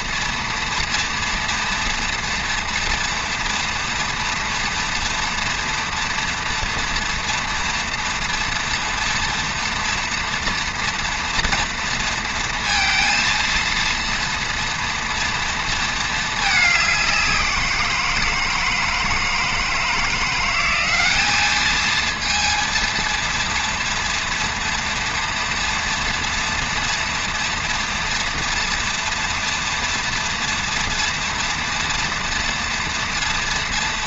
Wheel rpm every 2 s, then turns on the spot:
230, 240, 230, 230, 230, 230, 230, 230, 190, 160, 200, 230, 230, 230, 230, 230, 230.
none